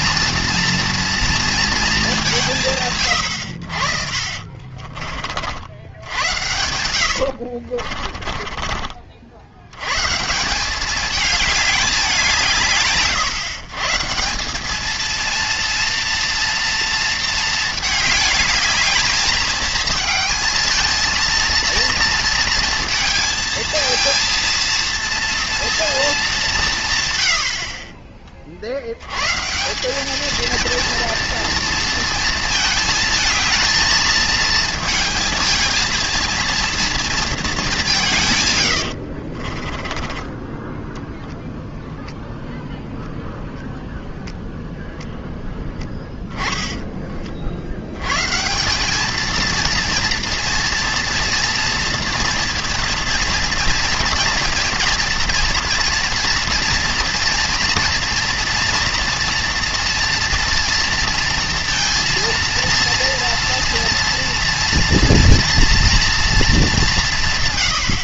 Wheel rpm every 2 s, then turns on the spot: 230, 130, 40, 90, 40, 200, 140, 210, 230, 220, 220, 230, 230, 150, 80, 230, 220, 220, 230, 110, 10, 0, 0, 10, 180, 240, 230, 230, 230, 230, 230, 230, 230, 210.
4-8 38-40